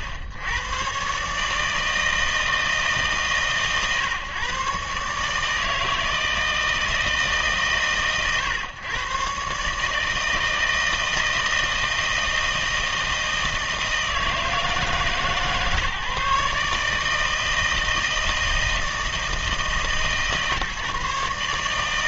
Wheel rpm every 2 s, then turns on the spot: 90, 160, 120, 160, 110, 160, 160, 160, 150, 160, 150.
none